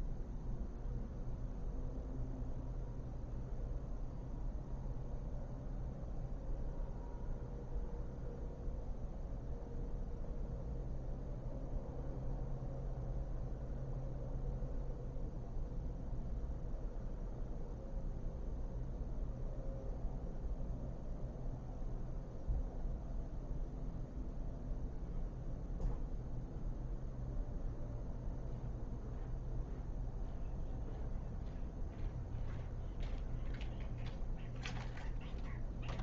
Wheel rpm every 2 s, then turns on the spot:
0, 0, 0, 0, 0, 0, 0, 0, 0, 0, 0, 0, 0, 0, 0, 0, 0, 0.
none